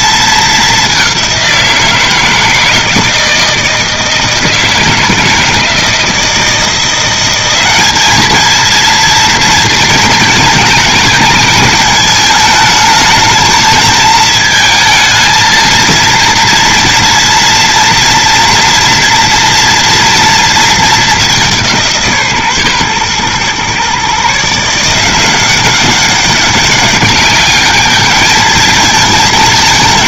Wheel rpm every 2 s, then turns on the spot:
210, 160, 160, 170, 220, 210, 210, 220, 230, 230, 230, 140, 160, 200, 220.
none